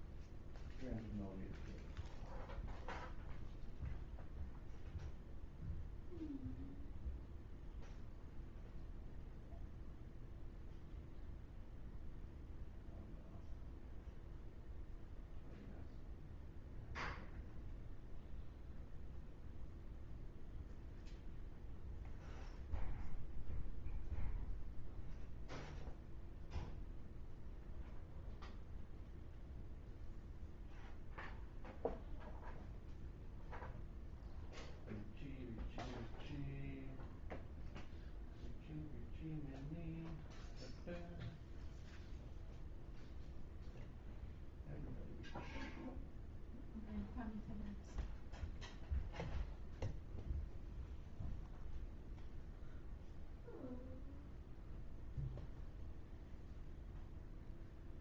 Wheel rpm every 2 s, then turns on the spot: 0, 0, 0, 0, 0, 0, 0, 0, 0, 0, 0, 0, 0, 0, 0, 0, 0, 0, 0, 0, 0, 0, 0, 0, 0, 0, 0, 0, 0.
none